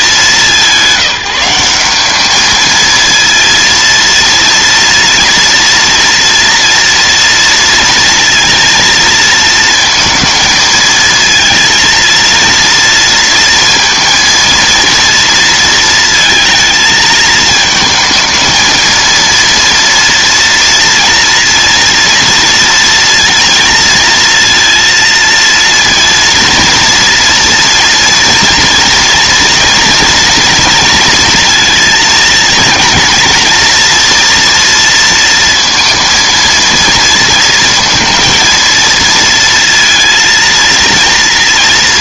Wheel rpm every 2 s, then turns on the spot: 200, 220, 230, 230, 230, 230, 230, 230, 230, 220, 230, 230, 230, 230, 240, 230, 230, 230, 230, 230, 230.
none